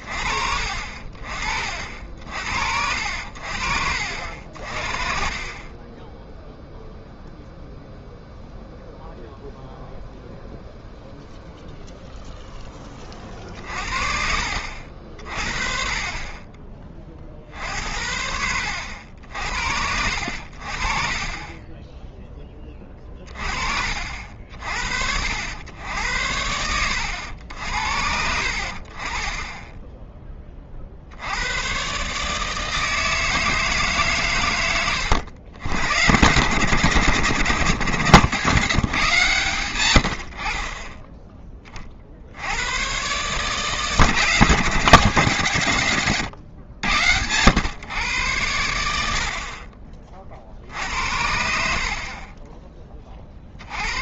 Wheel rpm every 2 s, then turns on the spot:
50, 70, 50, 0, 0, 0, 10, 50, 30, 80, 50, 20, 60, 80, 70, 30, 160, 110, 110, 130, 40, 100, 150, 110, 80, 60, 20.
none